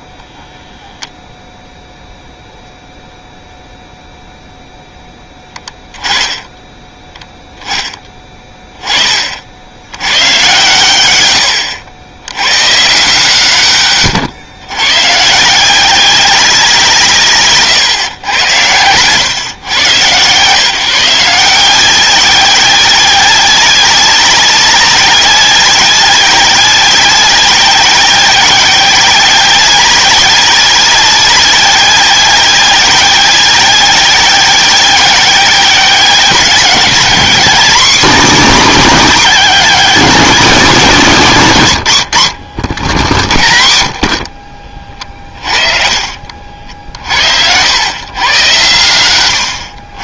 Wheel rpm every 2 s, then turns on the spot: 0, 0, 0, 10, 10, 120, 140, 120, 180, 90, 140, 190, 190, 190, 190, 190, 190, 190, 190, 190, 180, 80, 50, 60, 110.
42-48